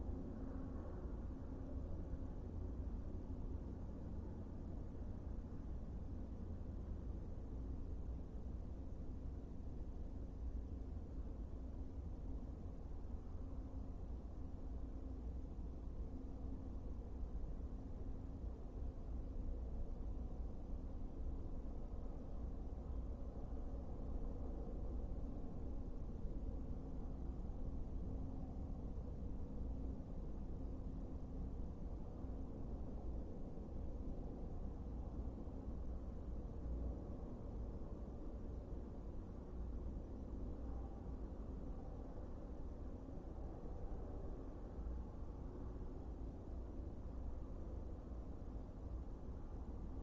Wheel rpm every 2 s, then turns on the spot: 0, 0, 0, 0, 0, 0, 0, 0, 0, 0, 0, 0, 0, 0, 0, 0, 0, 0, 0, 0, 0, 0, 0, 0, 0.
none